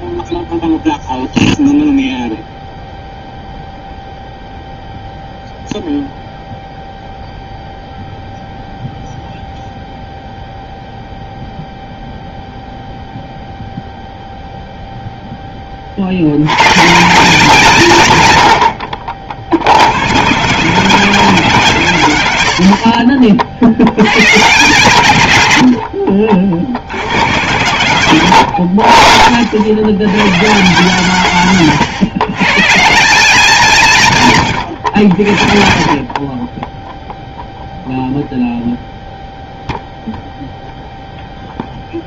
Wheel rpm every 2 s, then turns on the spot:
0, 0, 0, 0, 0, 0, 0, 0, 110, 90, 170, 100, 150, 70, 80, 150, 150, 130, 20, 0, 0.
28-30